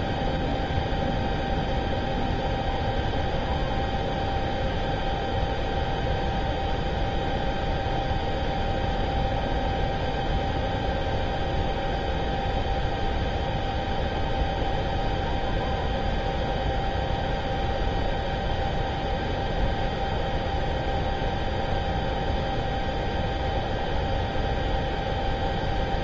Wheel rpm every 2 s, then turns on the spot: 0, 0, 0, 0, 0, 0, 0, 0, 0, 0, 0, 0, 0.
none